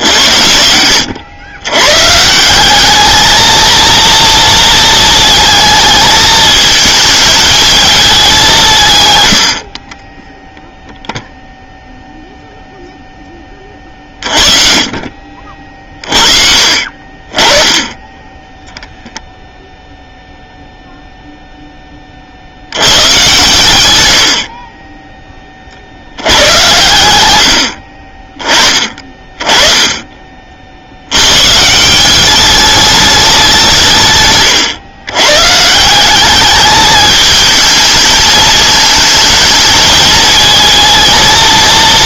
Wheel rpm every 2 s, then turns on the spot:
80, 180, 230, 220, 170, 0, 0, 40, 50, 10, 0, 80, 40, 110, 20, 40, 200, 130, 210, 220, 220.
none